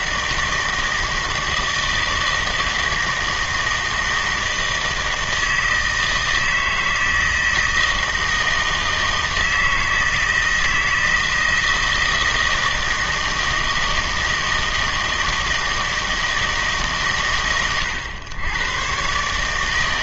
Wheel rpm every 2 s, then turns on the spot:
160, 160, 160, 160, 160, 160, 160, 160, 150, 120.
none